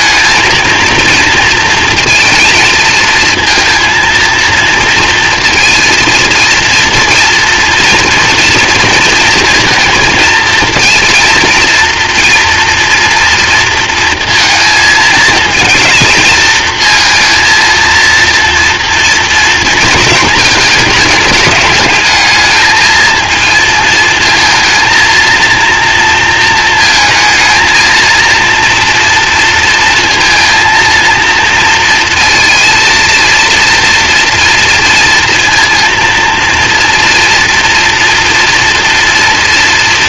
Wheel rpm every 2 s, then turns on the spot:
230, 230, 230, 230, 230, 230, 230, 230, 230, 230, 220, 220, 230, 230, 230, 230, 230, 230, 240, 230.
none